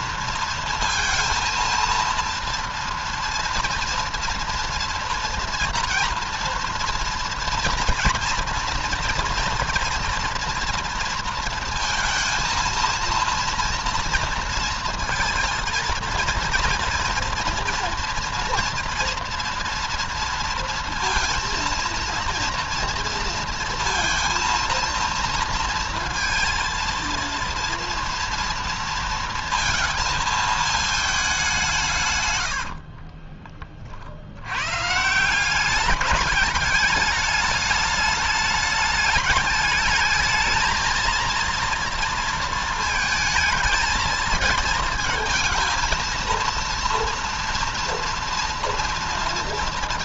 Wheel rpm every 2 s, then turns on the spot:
230, 230, 230, 230, 230, 230, 230, 230, 230, 230, 230, 230, 230, 230, 230, 220, 50, 130, 210, 210, 230, 230, 220, 230, 230.
32-34